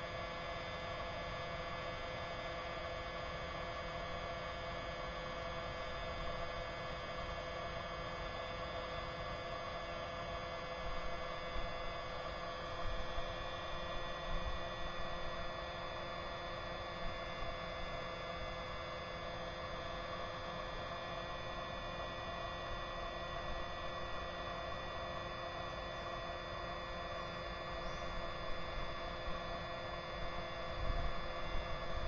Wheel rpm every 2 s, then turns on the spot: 0, 0, 0, 0, 0, 0, 0, 0, 0, 0, 0, 0, 0, 0, 0, 0.
none